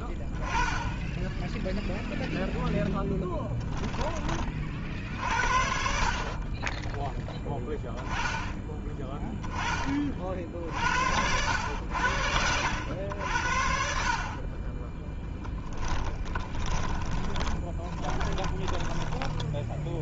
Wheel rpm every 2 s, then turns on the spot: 10, 0, 40, 10, 10, 50, 80, 10, 10, 20.
16-20